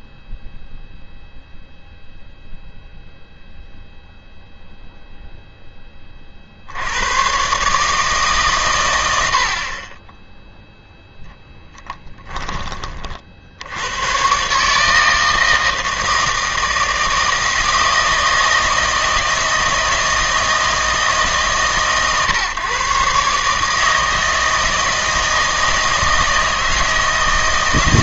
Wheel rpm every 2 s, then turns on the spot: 0, 0, 0, 60, 130, 0, 20, 150, 160, 160, 160, 120, 160, 160.
none